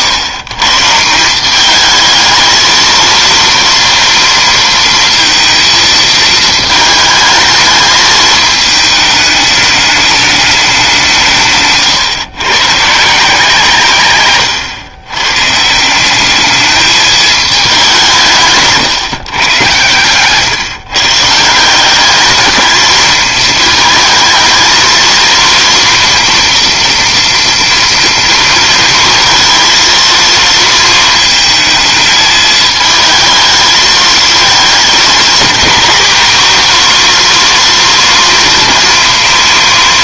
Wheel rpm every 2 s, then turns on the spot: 140, 220, 230, 220, 210, 200, 140, 120, 210, 150, 140, 220, 230, 240, 230, 230, 220, 220, 240, 230.
none